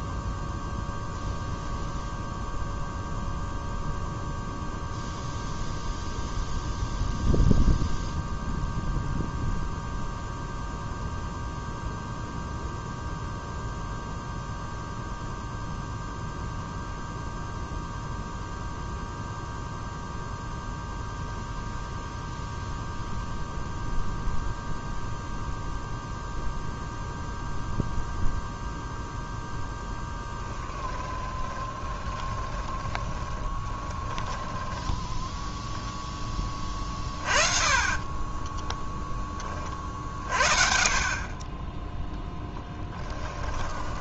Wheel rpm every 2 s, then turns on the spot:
0, 0, 0, 0, 0, 0, 0, 0, 0, 0, 0, 0, 0, 0, 0, 10, 20, 10, 30, 10, 40, 10.
30-34 36-38 40-44